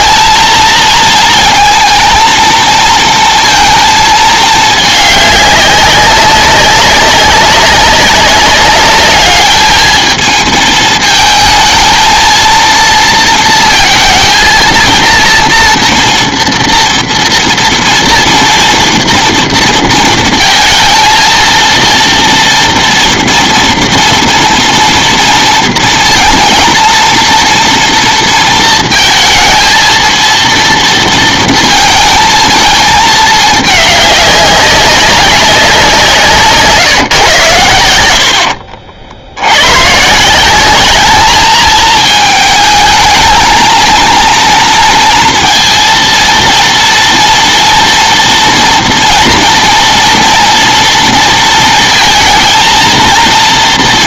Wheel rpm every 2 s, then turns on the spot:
220, 220, 210, 190, 200, 220, 230, 230, 230, 230, 230, 230, 230, 230, 230, 230, 220, 200, 150, 60, 190, 220, 230, 230, 230, 230, 230.
38-40